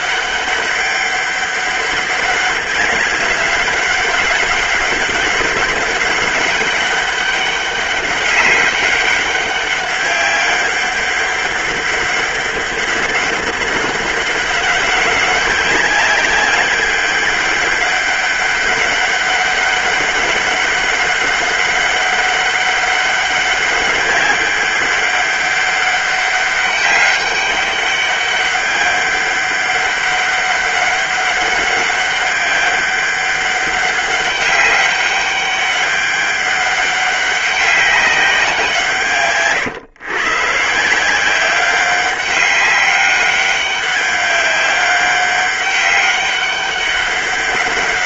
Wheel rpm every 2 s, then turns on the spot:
200, 200, 200, 200, 200, 200, 200, 200, 190, 190, 200, 200, 200, 200, 200, 200, 200, 200, 200, 180, 130, 190, 200, 200.
none